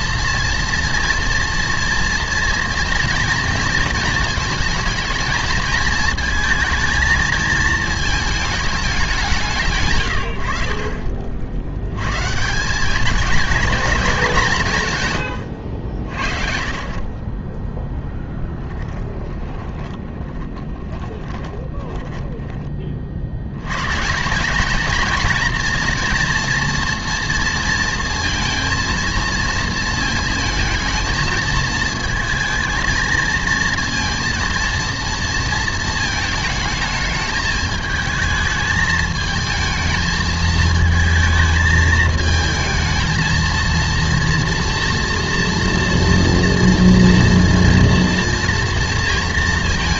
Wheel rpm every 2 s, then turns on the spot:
230, 240, 220, 220, 220, 70, 170, 180, 50, 10, 20, 20, 200, 230, 230, 230, 230, 230, 220, 220, 220, 220, 230, 230, 230.
18-24